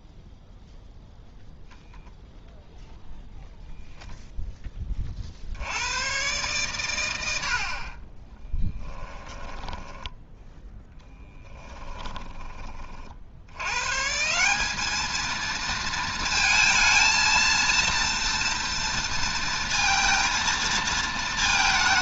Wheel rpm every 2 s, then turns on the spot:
0, 0, 20, 110, 10, 10, 40, 200, 230, 230, 230.
8-10